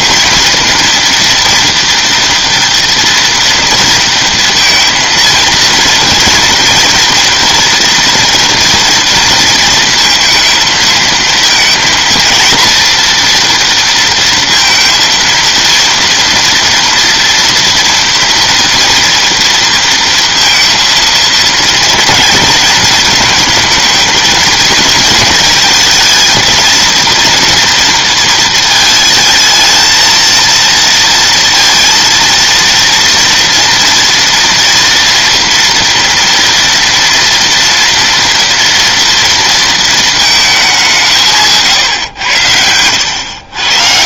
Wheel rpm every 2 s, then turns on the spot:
240, 230, 230, 230, 230, 230, 230, 230, 230, 240, 230, 230, 230, 230, 220, 230, 230, 230, 230, 230, 180, 90.
none